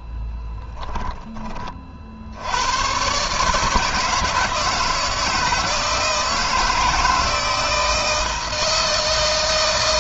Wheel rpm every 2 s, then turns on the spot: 10, 120, 160, 160, 160.
none